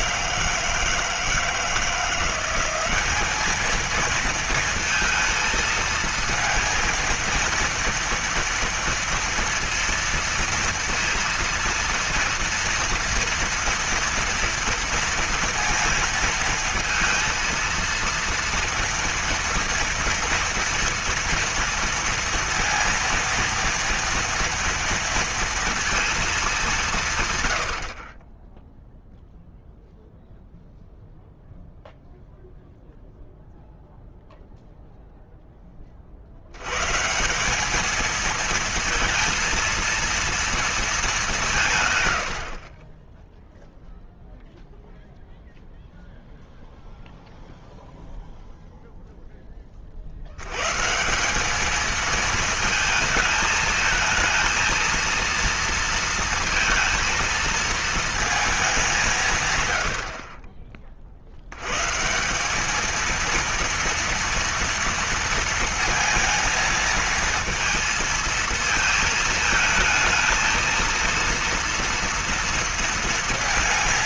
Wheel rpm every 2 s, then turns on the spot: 160, 190, 230, 230, 230, 230, 230, 230, 230, 230, 230, 230, 240, 200, 10, 0, 0, 0, 120, 230, 230, 40, 0, 0, 0, 110, 220, 230, 230, 200, 30, 200, 230, 230, 230, 230, 230.
none